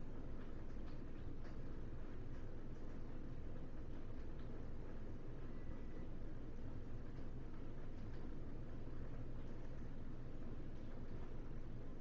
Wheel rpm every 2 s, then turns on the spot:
0, 0, 0, 0, 0, 0.
none